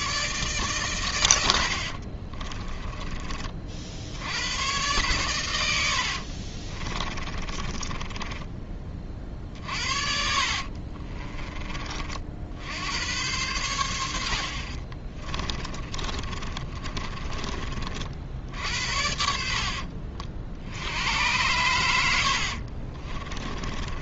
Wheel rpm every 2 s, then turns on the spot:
130, 20, 110, 30, 20, 50, 70, 50, 30, 70, 70, 50.
2-4 6-8 10-12 14-18 22-24